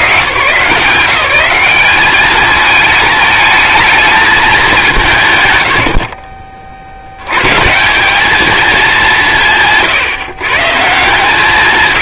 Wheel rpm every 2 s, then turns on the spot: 120, 210, 210, 40, 210, 120.
none